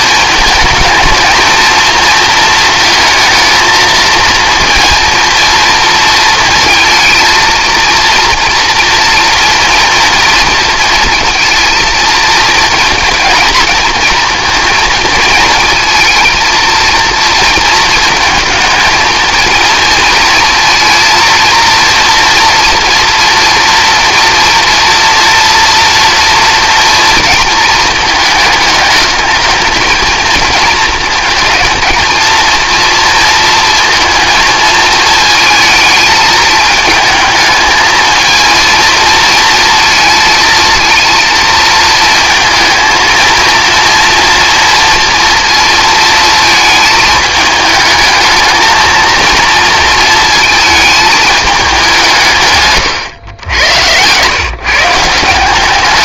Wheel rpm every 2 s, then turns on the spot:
220, 230, 230, 230, 230, 230, 230, 230, 230, 220, 230, 230, 230, 230, 210, 220, 230, 230, 210, 230, 230, 220, 230, 220, 220, 220, 140, 140.
none